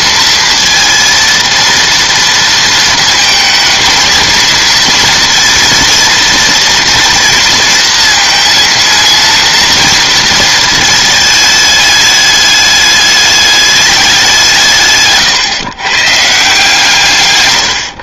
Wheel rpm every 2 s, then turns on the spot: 230, 230, 230, 230, 230, 220, 210, 140, 150.
none